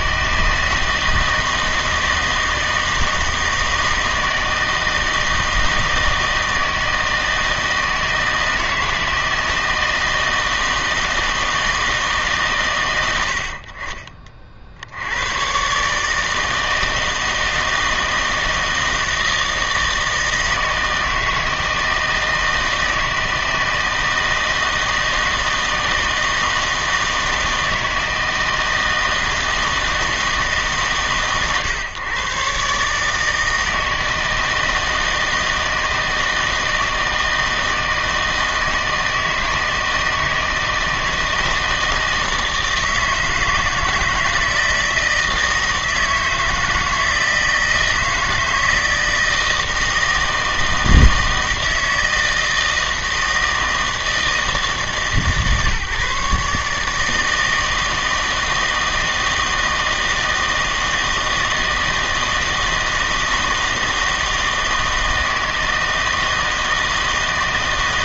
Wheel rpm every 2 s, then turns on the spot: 160, 160, 160, 160, 160, 160, 130, 60, 160, 160, 160, 160, 160, 160, 160, 150, 140, 160, 160, 160, 160, 160, 160, 160, 160, 160, 160, 150, 150, 160, 160, 160, 160, 160.
none